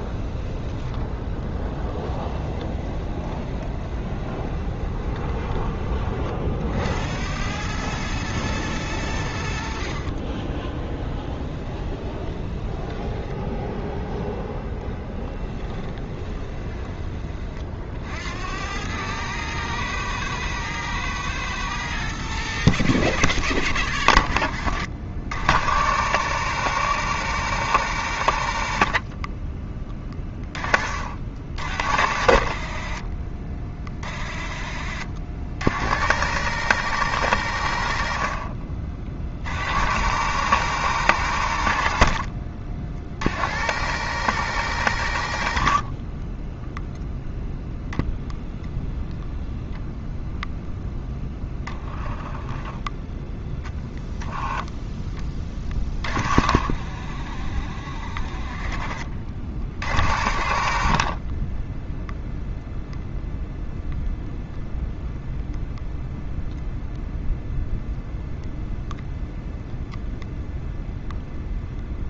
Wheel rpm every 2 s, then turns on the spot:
20, 30, 20, 50, 110, 30, 10, 0, 20, 80, 110, 110, 70, 110, 70, 30, 60, 50, 110, 50, 110, 60, 110, 10, 0, 0, 0, 0, 40, 40, 60, 0, 0, 0, 0, 0.
2-6 10-14 16-18 58-60